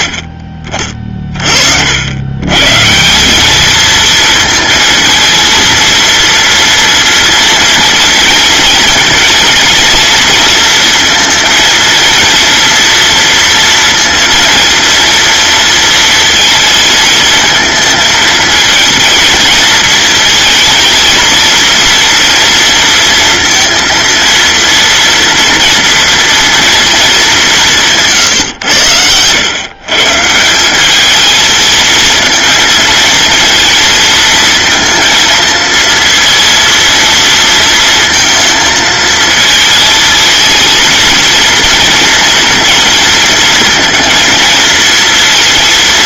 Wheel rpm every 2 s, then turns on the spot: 40, 130, 230, 230, 230, 230, 230, 230, 220, 230, 230, 230, 230, 230, 110, 180, 230, 230, 230, 220, 230, 240, 230.
28-30